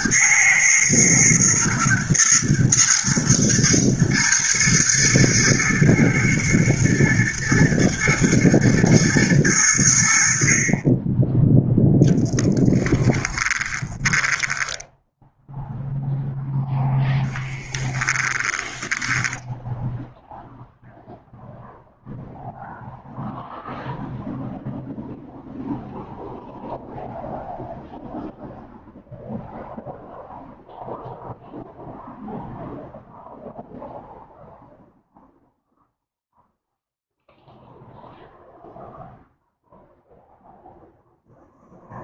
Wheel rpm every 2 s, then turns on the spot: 110, 120, 110, 120, 110, 20, 10, 0, 0, 10, 0, 0, 0, 0, 0, 0, 0, 0, 0, 0, 0.
12-14 18-20